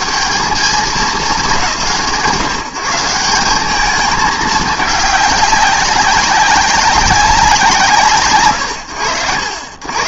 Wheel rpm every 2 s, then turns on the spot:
190, 160, 210, 200, 80.
none